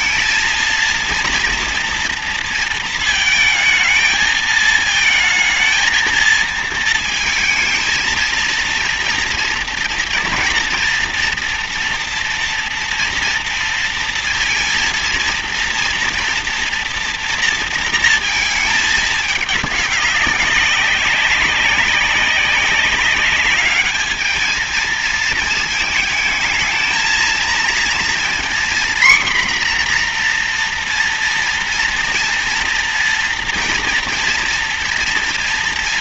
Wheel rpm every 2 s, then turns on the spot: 230, 230, 220, 220, 230, 230, 230, 230, 230, 220, 200, 200, 220, 220, 240, 240, 230, 240.
none